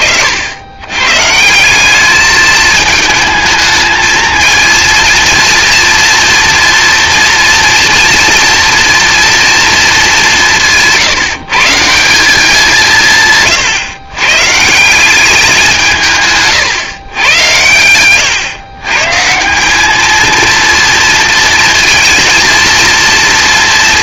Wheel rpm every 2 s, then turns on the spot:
100, 220, 230, 240, 240, 160, 160, 180, 120, 150, 230, 230.
none